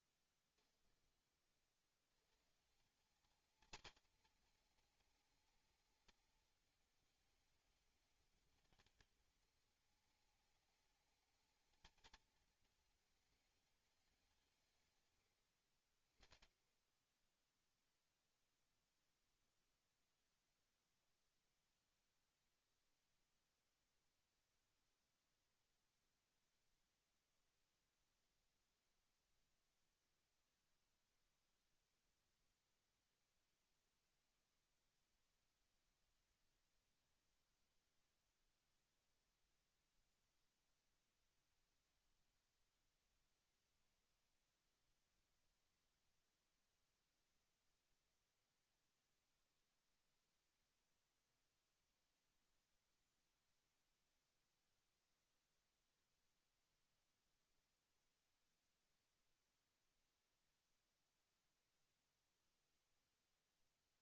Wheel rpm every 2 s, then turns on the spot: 20, 160, 210, 210, 210, 210, 220, 150, 20, 0, 0, 0, 0, 0, 0, 0, 0, 0, 0, 0, 0, 0, 0, 0, 0, 0, 0, 0, 0, 0, 0, 0.
0-2